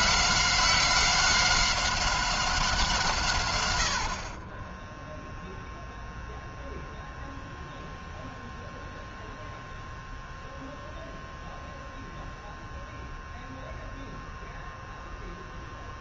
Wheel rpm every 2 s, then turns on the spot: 190, 160, 10, 0, 0, 0, 0, 0.
none